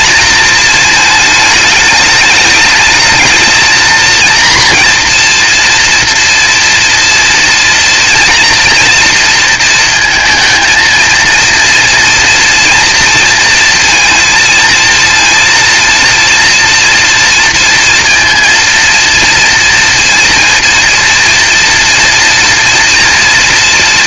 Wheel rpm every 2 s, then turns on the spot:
230, 210, 230, 230, 240, 230, 230, 230, 230, 230, 240, 230.
none